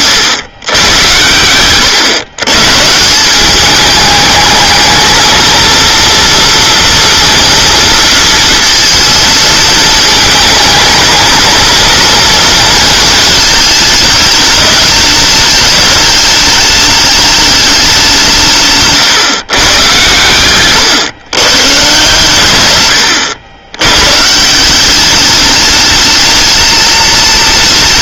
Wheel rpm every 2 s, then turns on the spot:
110, 130, 220, 230, 230, 220, 220, 210, 210, 160, 100, 80, 180, 220.
20-22